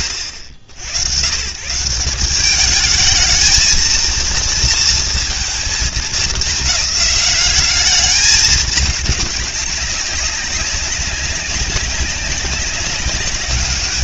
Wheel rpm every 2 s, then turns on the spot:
100, 200, 230, 210, 210, 190, 200.
none